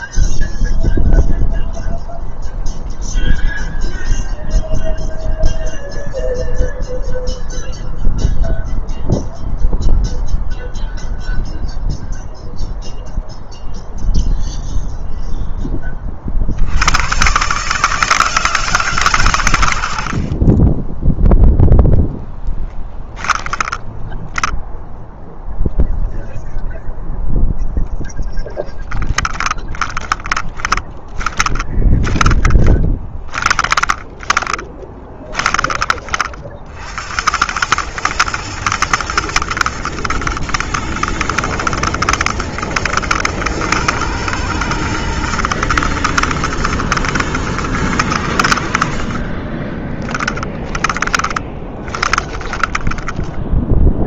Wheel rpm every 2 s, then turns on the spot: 0, 0, 0, 0, 0, 0, 0, 0, 110, 130, 10, 10, 0, 0, 10, 20, 20, 20, 80, 120, 120, 110, 120, 110, 50, 10, 10.
22-24 28-36 48-54